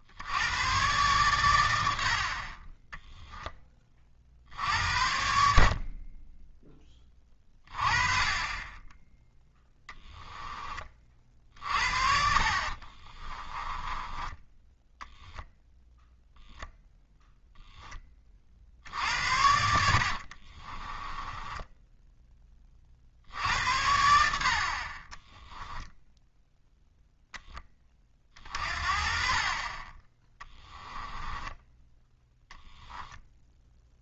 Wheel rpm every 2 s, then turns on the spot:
110, 20, 60, 10, 20, 30, 40, 0, 0, 60, 30, 40, 50, 0, 40, 10, 0.
12-14 20-22 30-32